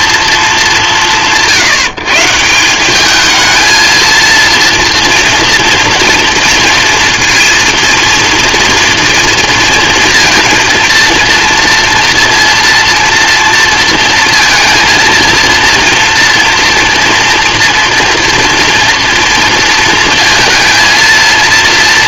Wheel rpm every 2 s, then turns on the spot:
210, 170, 230, 240, 240, 230, 230, 230, 240, 230, 220.
none